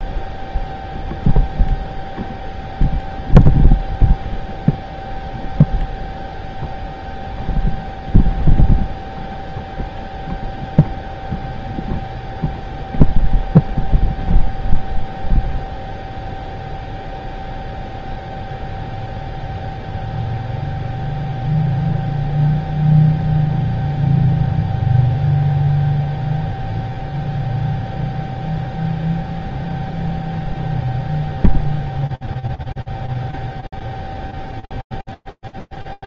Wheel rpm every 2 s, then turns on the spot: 0, 0, 0, 0, 0, 0, 0, 0, 0, 0, 0, 0, 0, 0, 0, 0, 0, 0.
none